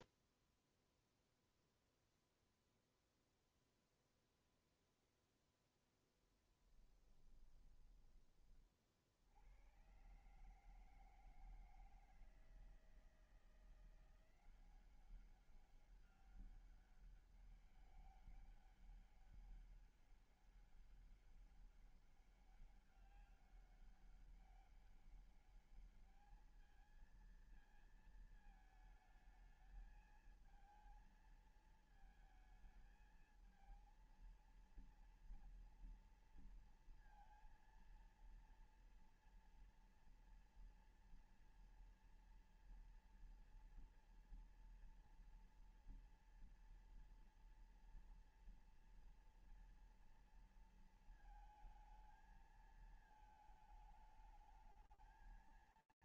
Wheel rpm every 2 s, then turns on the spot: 0, 0, 0, 10, 30, 150, 160, 180, 200, 200, 200, 200, 200, 210, 220, 220, 220, 220, 230, 230, 230, 230, 230, 230, 240, 230, 220, 220.
6-8